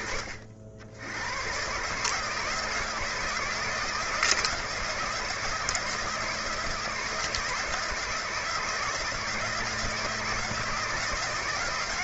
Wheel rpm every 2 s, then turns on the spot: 70, 160, 160, 160, 160, 160.
none